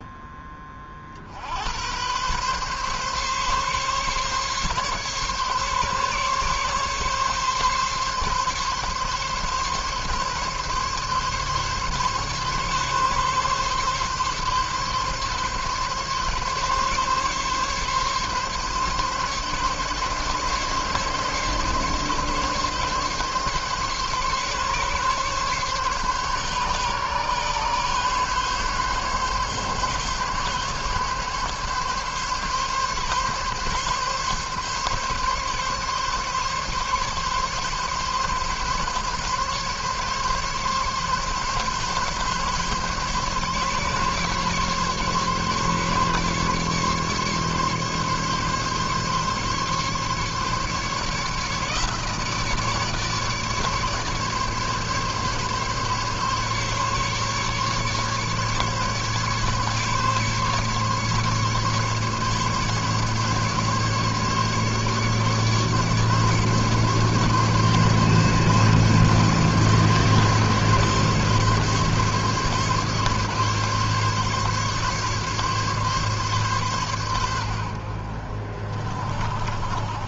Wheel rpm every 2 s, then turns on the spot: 20, 130, 140, 140, 140, 140, 140, 140, 140, 140, 140, 140, 140, 140, 140, 140, 140, 140, 140, 140, 140, 140, 140, 140, 140, 150, 150, 150, 140, 140, 140, 140, 140, 140, 140, 140, 140, 140, 130, 50.
none